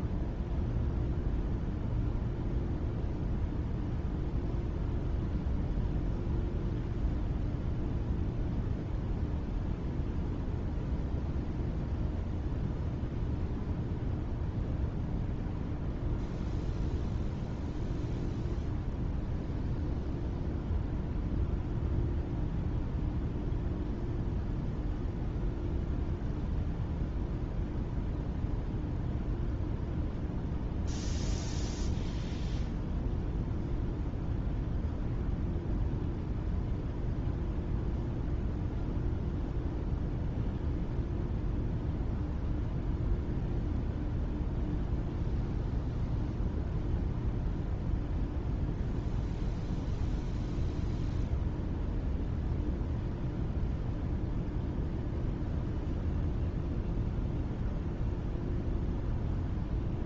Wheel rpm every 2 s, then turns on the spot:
0, 0, 0, 0, 0, 0, 0, 0, 0, 0, 0, 0, 0, 0, 0, 0, 0, 0, 0, 0, 0, 0, 0, 0, 0, 0, 0, 0, 0, 0.
none